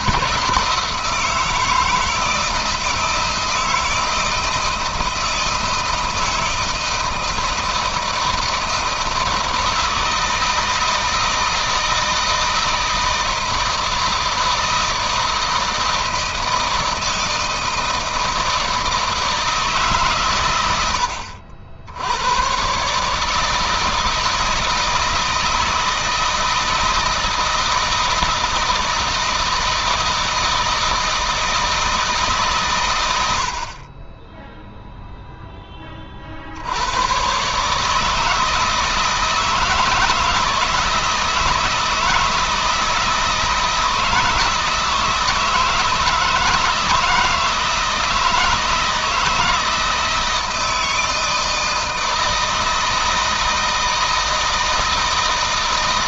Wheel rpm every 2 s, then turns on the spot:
160, 160, 160, 170, 160, 160, 160, 160, 160, 160, 100, 130, 160, 160, 160, 160, 120, 0, 80, 160, 160, 160, 160, 160, 160, 160, 160, 160.
none